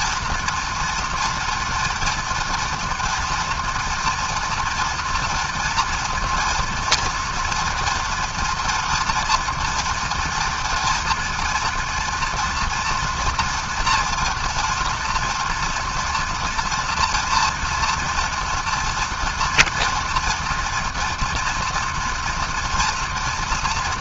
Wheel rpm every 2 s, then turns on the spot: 230, 230, 240, 230, 240, 230, 240, 240, 230, 230, 230, 230.
none